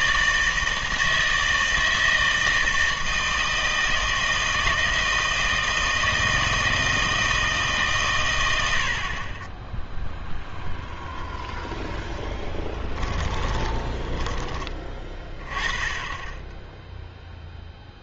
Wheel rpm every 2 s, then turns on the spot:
160, 160, 160, 160, 90, 0, 10, 20, 0.
12-14